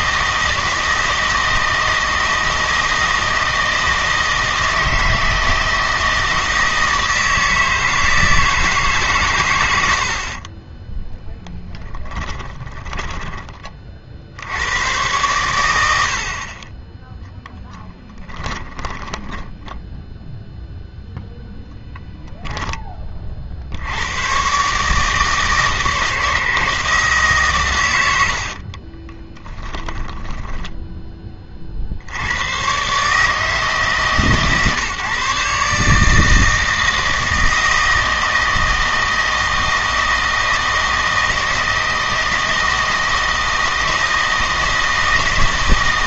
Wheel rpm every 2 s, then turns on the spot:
160, 160, 160, 160, 150, 30, 20, 90, 30, 20, 0, 10, 140, 160, 50, 10, 120, 150, 160, 160, 160, 160, 160.
12-14 18-20 28-32